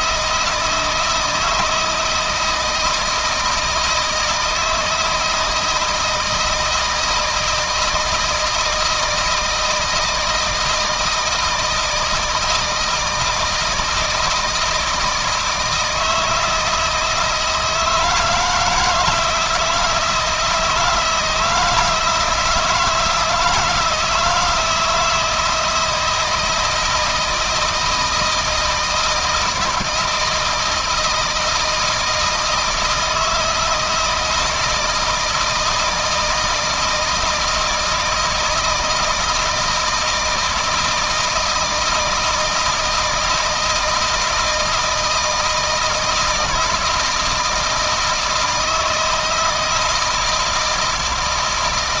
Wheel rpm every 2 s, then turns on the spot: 160, 160, 160, 160, 160, 160, 160, 160, 160, 160, 160, 160, 160, 160, 160, 170, 160, 160, 160, 160, 160, 160, 170, 160, 160, 160.
none